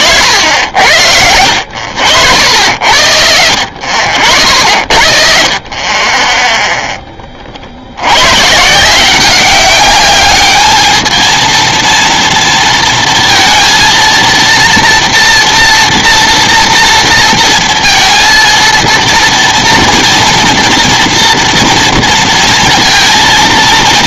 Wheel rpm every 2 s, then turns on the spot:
50, 70, 70, 20, 100, 200, 230, 230, 230, 230, 230, 230.
none